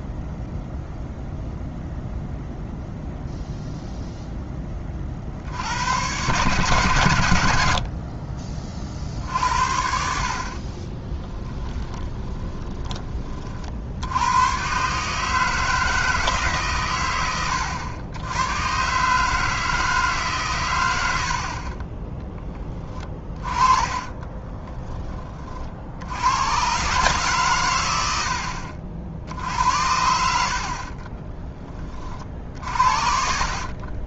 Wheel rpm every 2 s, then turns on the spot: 0, 0, 20, 110, 40, 20, 20, 130, 120, 130, 100, 20, 20, 130, 60, 50, 60.
10-12 30-34